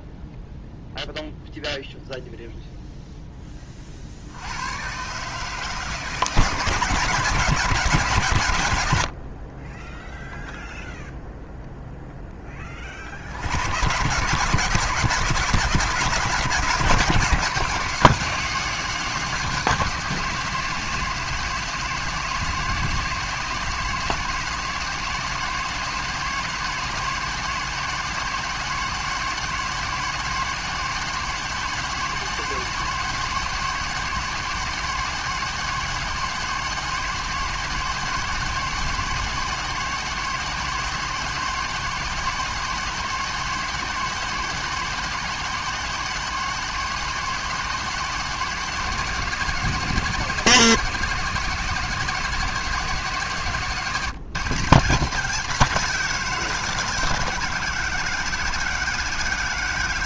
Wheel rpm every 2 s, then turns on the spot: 0, 0, 100, 160, 110, 0, 20, 160, 160, 170, 170, 160, 170, 170, 170, 170, 170, 170, 170, 170, 170, 170, 170, 170, 160, 170, 160, 170, 160, 160.
none